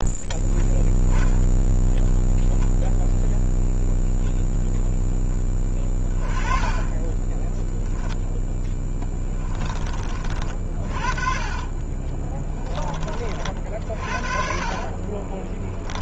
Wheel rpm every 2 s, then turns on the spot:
10, 0, 0, 30, 10, 40, 10, 50.
6-10 14-16